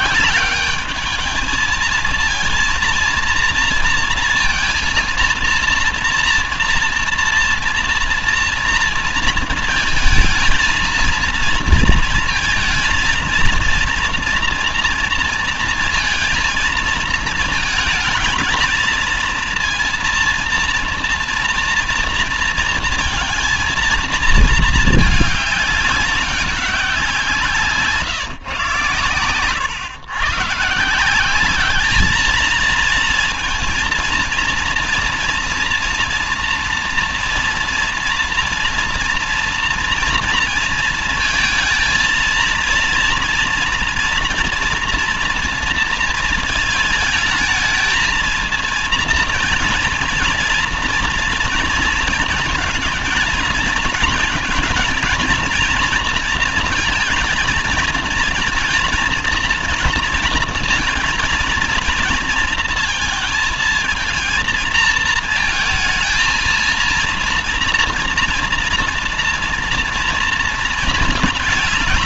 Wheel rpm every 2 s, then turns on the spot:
190, 230, 230, 230, 230, 230, 230, 230, 230, 220, 230, 230, 220, 180, 120, 150, 220, 230, 230, 240, 230, 230, 240, 220, 230, 230, 230, 240, 230, 220, 230, 230, 220, 230, 240, 220.
none